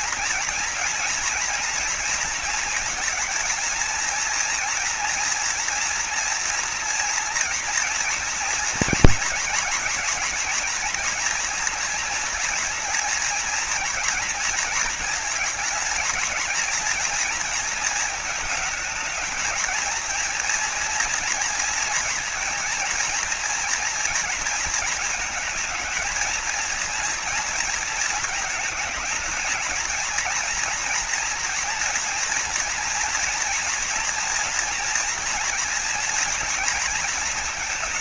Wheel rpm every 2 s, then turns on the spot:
220, 230, 240, 230, 240, 230, 230, 220, 230, 220, 240, 230, 210, 230, 220, 240, 240, 230, 220.
none